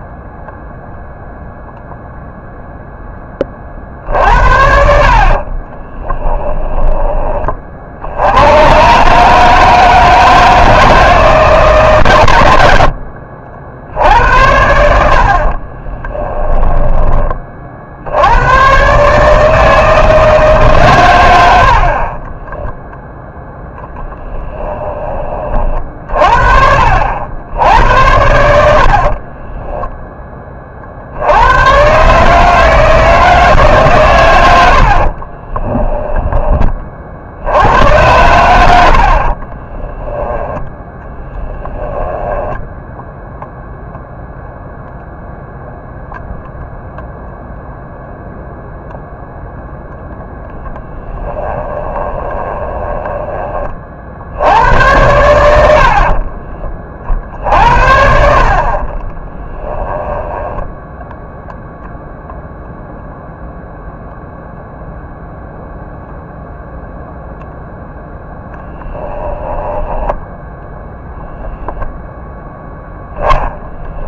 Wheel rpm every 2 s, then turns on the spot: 0, 0, 70, 10, 130, 160, 80, 80, 10, 130, 140, 10, 10, 60, 70, 40, 160, 70, 30, 80, 10, 10, 0, 0, 0, 10, 20, 90, 30, 40, 10, 0, 0, 0, 10, 0, 0.
16-18 22-24 28-30 34-36 40-44 52-54 58-62 68-70